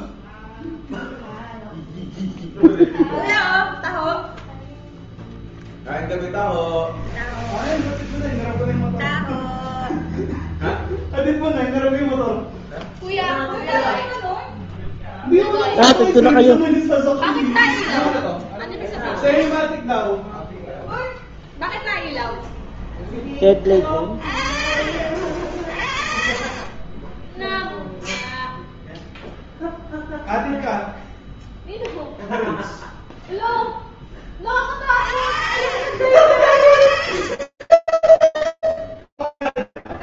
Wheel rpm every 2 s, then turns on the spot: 0, 0, 0, 10, 0, 0, 0, 0, 20, 10, 0, 0, 40, 20, 0, 0, 0, 50, 50, 0.
6-8